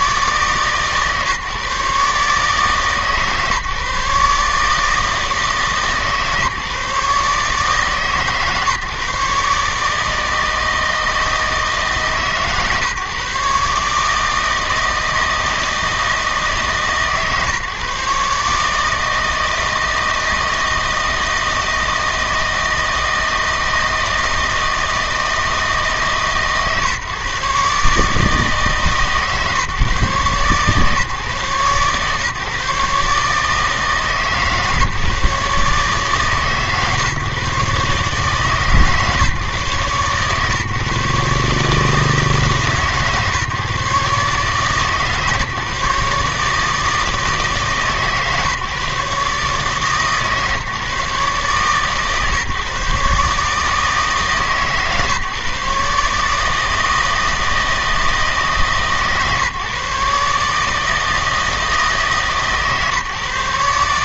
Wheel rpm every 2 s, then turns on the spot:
150, 150, 150, 150, 150, 160, 140, 160, 150, 150, 160, 160, 160, 140, 150, 130, 140, 150, 140, 140, 140, 150, 150, 150, 150, 150, 140, 140, 160, 150, 150, 140.
none